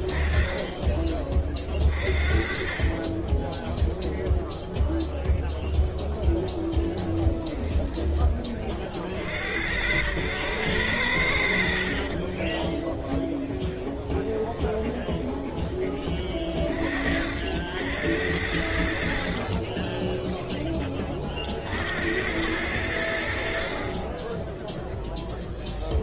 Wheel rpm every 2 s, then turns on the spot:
20, 30, 0, 0, 30, 90, 10, 20, 40, 70, 10, 90, 10.
12-16